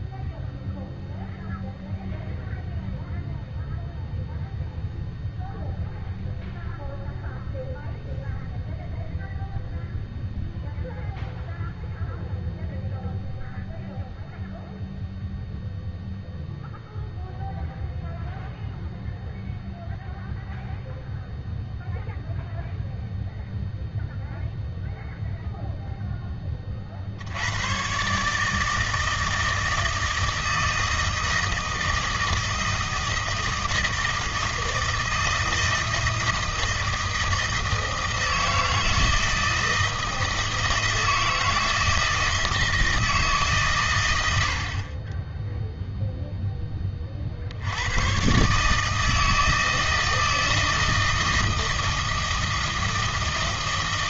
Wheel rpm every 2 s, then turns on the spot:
0, 0, 0, 0, 0, 0, 0, 0, 0, 0, 0, 0, 0, 30, 160, 160, 160, 160, 160, 160, 160, 160, 60, 10, 150, 160, 160.
none